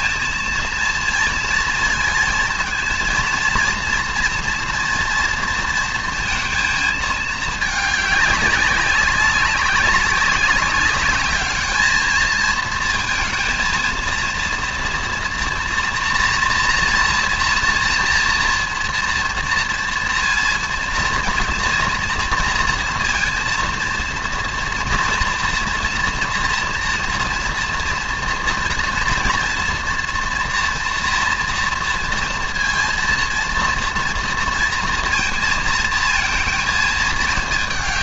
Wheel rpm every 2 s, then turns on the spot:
230, 230, 230, 220, 200, 210, 220, 230, 230, 230, 230, 230, 230, 230, 230, 230, 230, 230, 220.
none